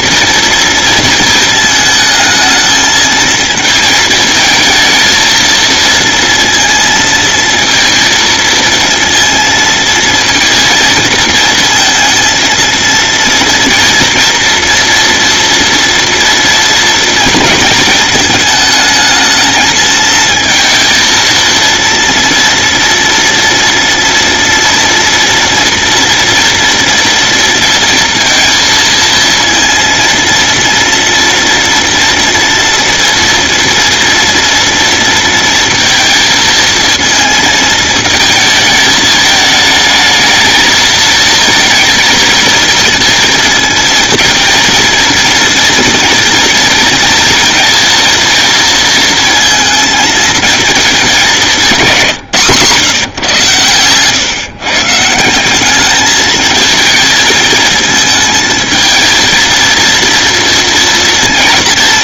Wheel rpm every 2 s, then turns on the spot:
230, 220, 220, 230, 230, 230, 230, 230, 230, 220, 220, 230, 230, 230, 230, 230, 230, 230, 230, 220, 220, 220, 230, 230, 230, 210, 140, 150, 220, 220, 230.
none